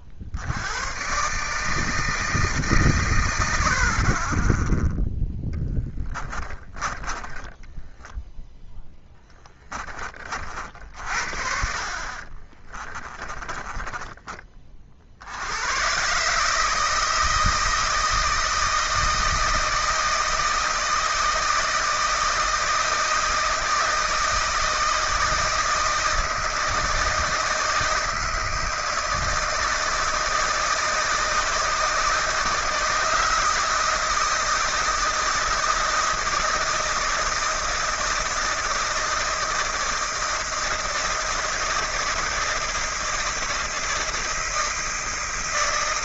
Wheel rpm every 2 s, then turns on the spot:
90, 150, 10, 20, 10, 50, 20, 30, 150, 160, 160, 160, 160, 160, 160, 160, 160, 160, 160, 160, 160, 160, 160.
6-8 12-14